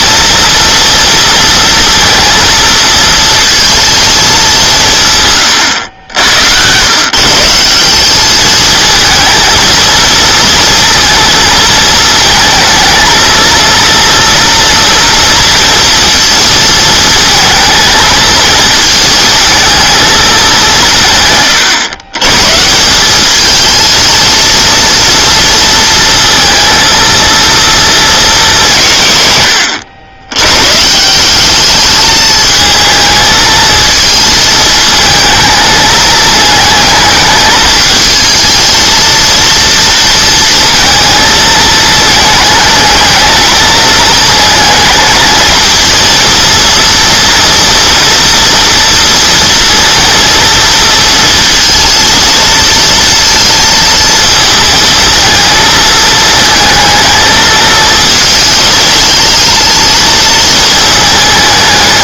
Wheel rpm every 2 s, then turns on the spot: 230, 230, 170, 120, 220, 230, 220, 230, 220, 220, 180, 170, 230, 230, 160, 130, 220, 220, 220, 220, 230, 210, 220, 230, 240, 230, 230, 230, 220, 220, 220.
none